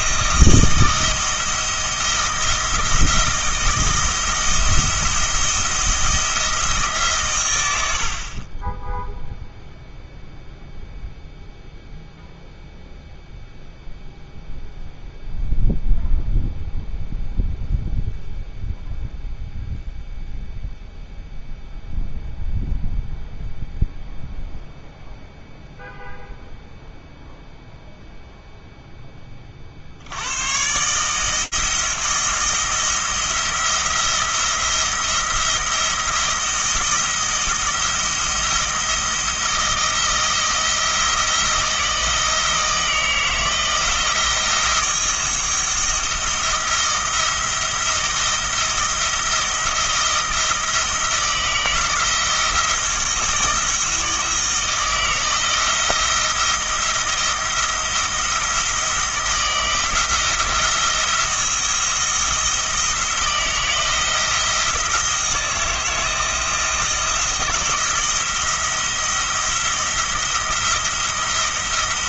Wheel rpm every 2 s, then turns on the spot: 160, 170, 170, 160, 20, 0, 0, 0, 0, 0, 0, 0, 0, 0, 0, 130, 170, 170, 170, 170, 170, 160, 170, 170, 170, 160, 170, 160, 170, 170, 170, 170, 170, 160, 170, 170.
none